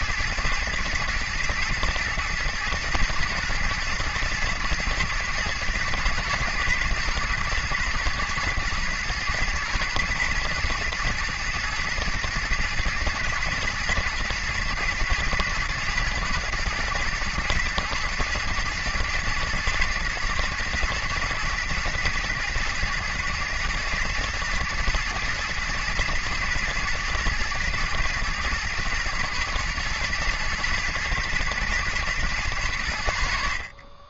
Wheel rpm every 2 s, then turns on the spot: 110, 110, 120, 110, 120, 120, 120, 110, 110, 110, 120, 110, 110, 120, 120, 120, 90.
none